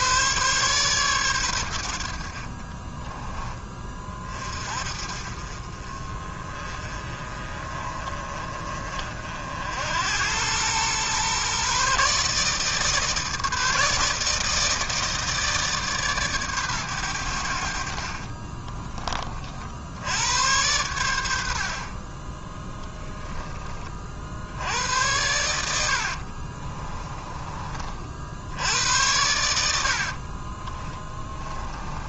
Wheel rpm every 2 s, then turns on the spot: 130, 30, 40, 30, 50, 120, 150, 160, 100, 30, 100, 10, 90, 30, 100, 20.
22-24 26-28 30-32